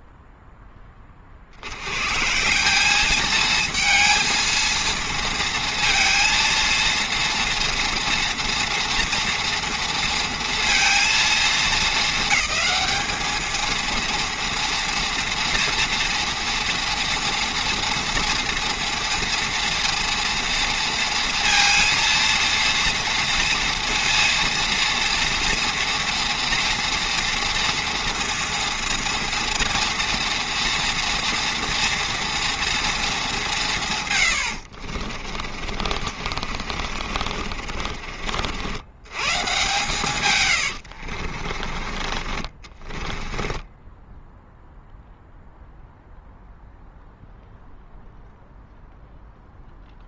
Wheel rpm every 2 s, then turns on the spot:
60, 220, 230, 230, 230, 210, 220, 230, 230, 230, 230, 230, 240, 230, 230, 230, 190, 40, 40, 120, 50, 10, 0, 0, 0.
34-38 40-44